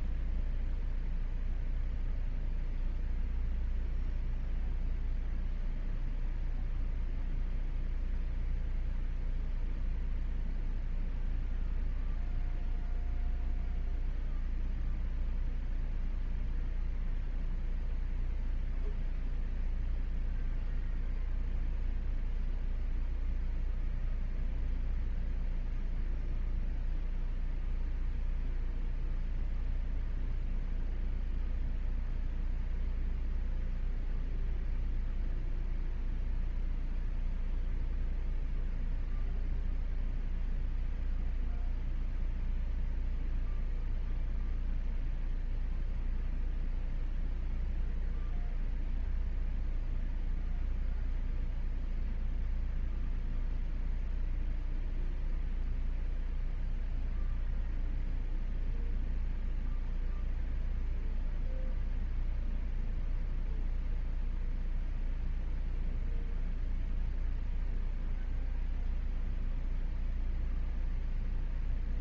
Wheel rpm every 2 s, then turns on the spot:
0, 0, 0, 0, 0, 0, 0, 0, 0, 0, 0, 0, 0, 0, 0, 0, 0, 0, 0, 0, 0, 0, 0, 0, 0, 0, 0, 0, 0, 0, 0, 0, 0, 0, 0, 0.
none